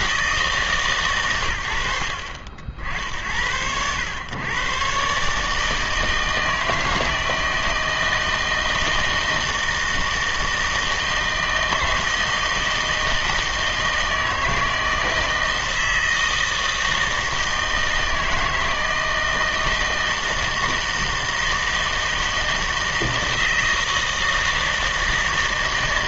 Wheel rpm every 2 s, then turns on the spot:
150, 60, 120, 160, 160, 160, 160, 160, 160, 160, 160, 160, 160.
none